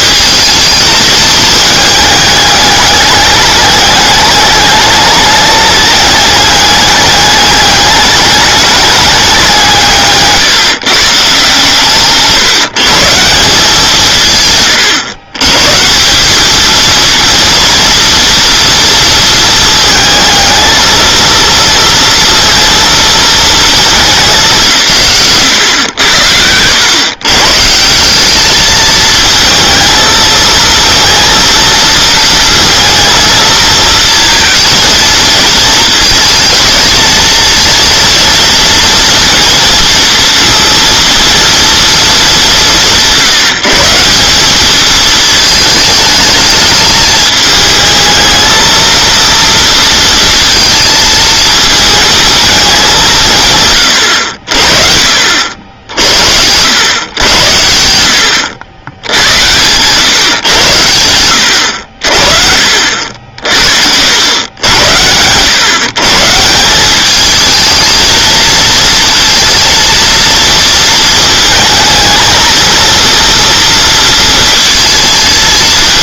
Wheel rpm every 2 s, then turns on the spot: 220, 210, 210, 210, 210, 150, 150, 140, 210, 230, 220, 230, 170, 100, 210, 230, 230, 220, 220, 230, 230, 200, 210, 220, 230, 230, 210, 60, 100, 90, 120, 50, 90, 170, 230, 230, 230, 230.
none